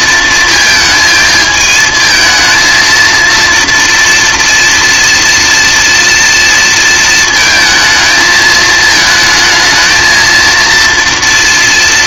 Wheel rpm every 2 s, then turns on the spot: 220, 220, 230, 230, 220, 230.
none